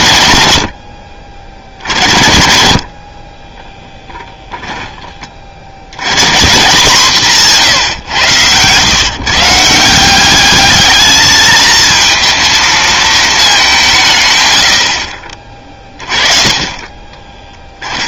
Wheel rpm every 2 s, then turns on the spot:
70, 10, 120, 150, 170, 220, 160, 30, 10.
2-4